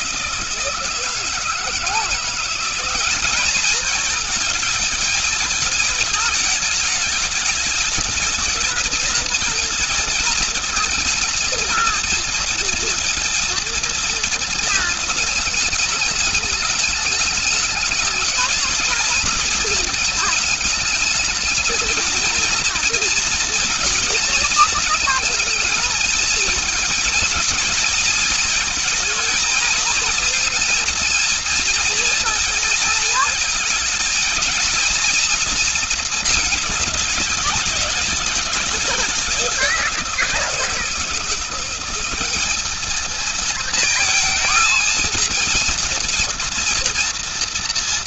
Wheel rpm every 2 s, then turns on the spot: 170, 180, 220, 220, 220, 220, 230, 220, 210, 220, 210, 230, 230, 230, 230, 230, 220, 230, 210, 200, 180, 220, 230, 230.
none